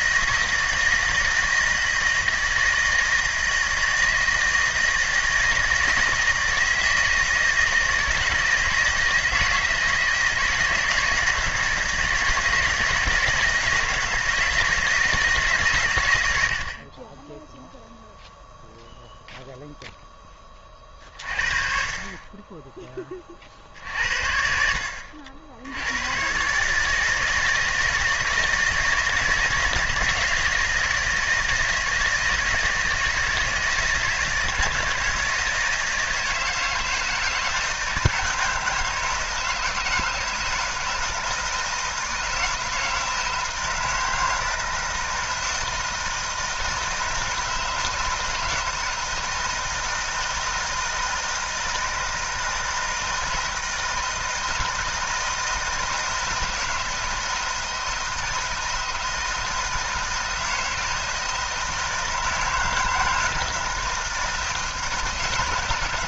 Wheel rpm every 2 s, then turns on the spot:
160, 160, 160, 160, 160, 160, 160, 160, 60, 0, 30, 20, 60, 140, 160, 170, 160, 160, 160, 160, 160, 160, 160, 160, 160, 160, 160, 160, 160, 160, 160, 160, 160.
none